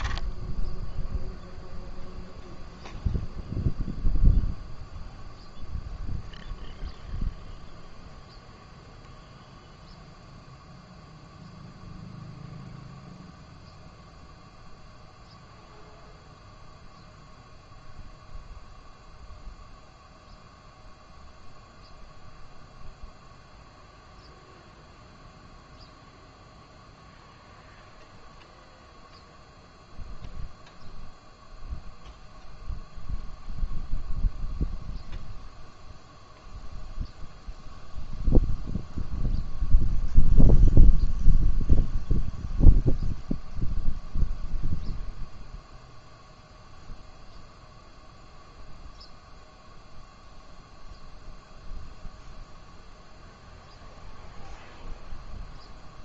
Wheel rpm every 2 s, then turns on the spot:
10, 0, 0, 0, 0, 0, 0, 0, 0, 0, 0, 0, 0, 0, 0, 0, 0, 0, 0, 0, 0, 0, 0, 0, 0, 0, 0, 0.
0-2